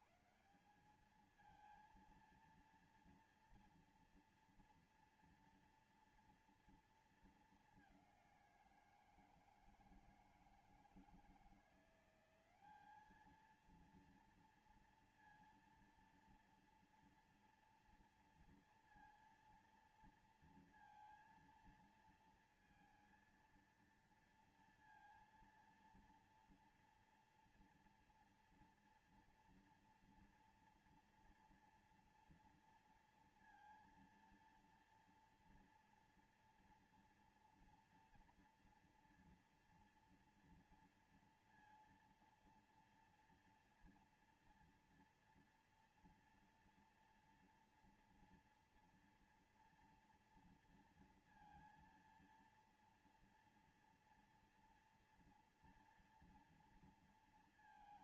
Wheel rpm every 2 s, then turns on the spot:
150, 220, 230, 230, 200, 160, 180, 230, 230, 230, 230, 230, 230, 230, 240, 240, 230, 230, 230, 240, 230, 230, 230, 230, 230, 230, 230, 230, 230.
none